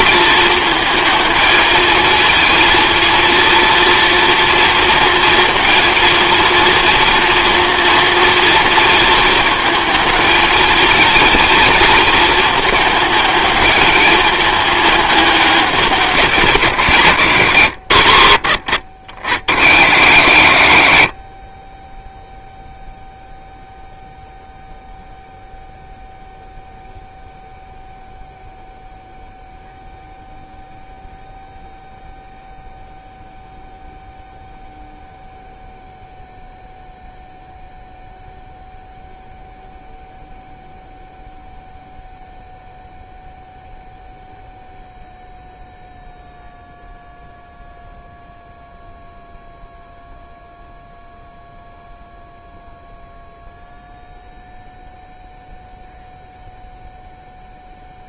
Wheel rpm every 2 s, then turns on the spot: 220, 230, 230, 230, 230, 230, 210, 210, 140, 60, 50, 0, 0, 0, 0, 0, 0, 0, 0, 0, 0, 0, 0, 0, 0, 0, 0, 0, 0.
none